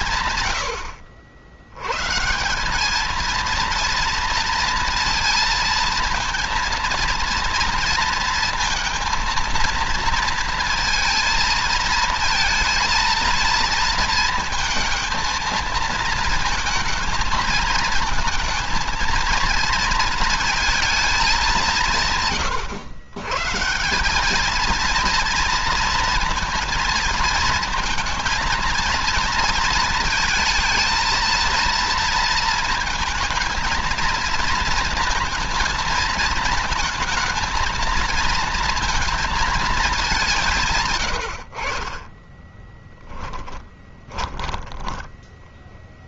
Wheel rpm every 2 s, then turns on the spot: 100, 220, 230, 230, 230, 230, 230, 230, 220, 230, 220, 140, 230, 230, 230, 230, 220, 220, 220, 230, 80, 20, 10.
42-46